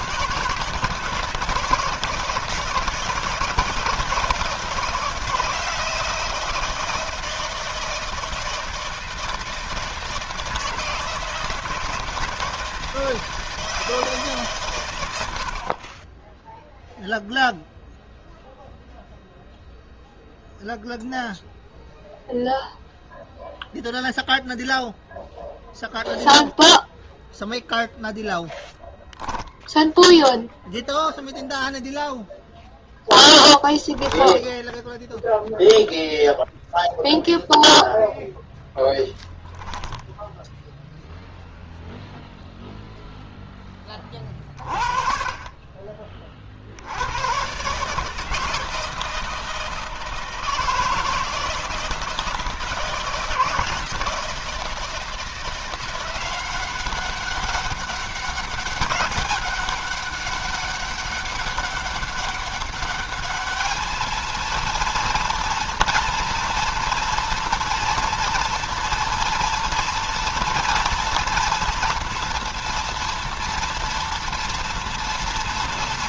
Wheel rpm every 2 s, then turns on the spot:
160, 170, 160, 160, 160, 160, 160, 140, 0, 0, 0, 0, 0, 0, 0, 0, 0, 10, 0, 0, 0, 0, 30, 40, 150, 160, 160, 160, 180, 200, 200, 200, 220, 230, 230, 230, 240, 230.
none